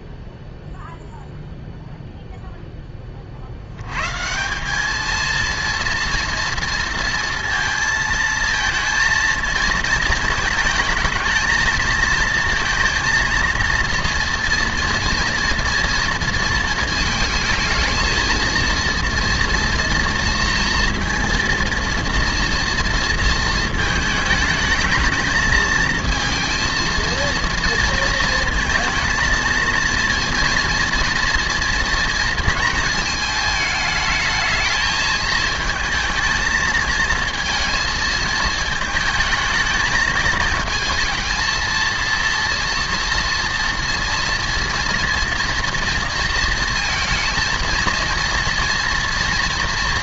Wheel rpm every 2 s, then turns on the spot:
0, 10, 190, 230, 220, 220, 230, 230, 230, 230, 230, 230, 220, 230, 220, 230, 220, 220, 220, 220, 220, 230, 230, 230, 230.
none